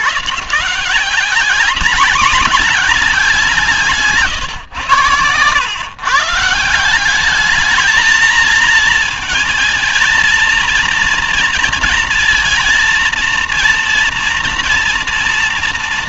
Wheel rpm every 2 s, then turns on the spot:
150, 210, 120, 160, 220, 230, 230, 230.
none